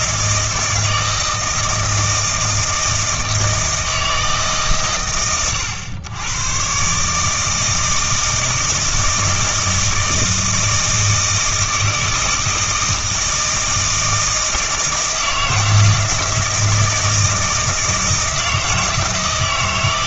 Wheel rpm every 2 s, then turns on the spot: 160, 160, 130, 120, 160, 160, 160, 160, 160, 160.
none